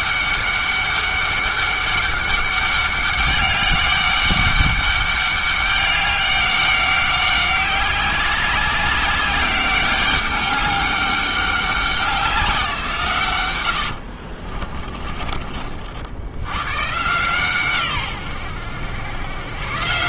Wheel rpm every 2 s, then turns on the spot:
200, 200, 200, 190, 190, 200, 170, 40, 110, 100.
14-16